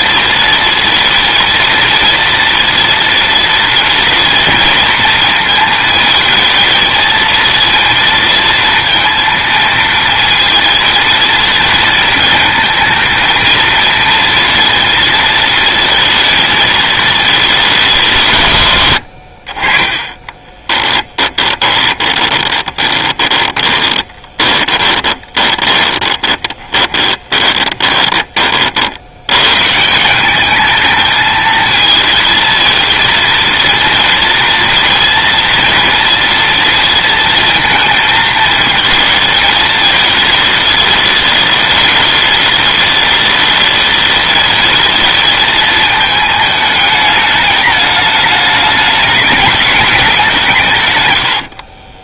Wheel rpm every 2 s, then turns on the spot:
230, 230, 230, 230, 230, 230, 230, 230, 220, 100, 20, 20, 20, 30, 70, 220, 230, 230, 230, 220, 210, 210, 220, 210, 210, 110.
18-28